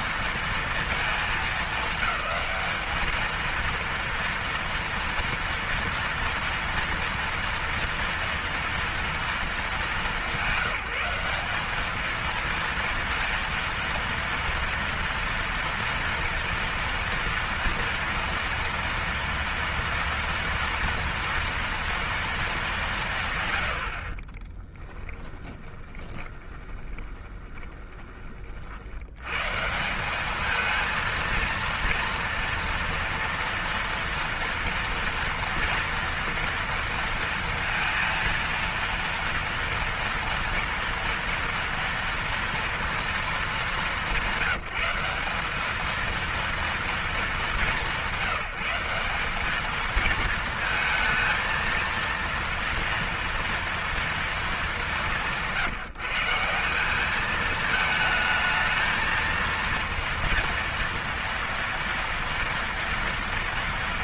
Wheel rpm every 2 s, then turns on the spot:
230, 210, 230, 230, 230, 190, 210, 230, 230, 230, 230, 230, 50, 20, 30, 190, 230, 240, 230, 230, 240, 240, 190, 220, 180, 220, 230, 230, 160, 220, 230, 230.
26-28